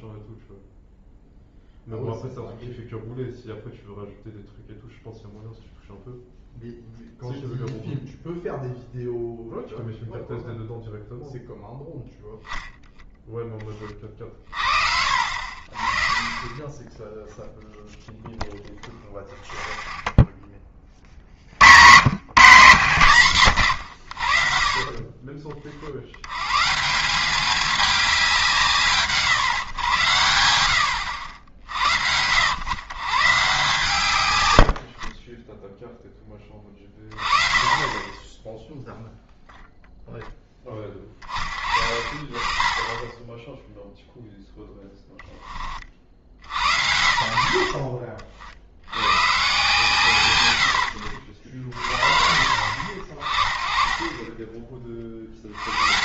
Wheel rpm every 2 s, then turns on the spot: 0, 0, 0, 0, 0, 0, 0, 40, 10, 0, 20, 150, 50, 160, 170, 90, 110, 90, 20, 0, 10, 30, 0, 50, 70, 100, 50, 20.
none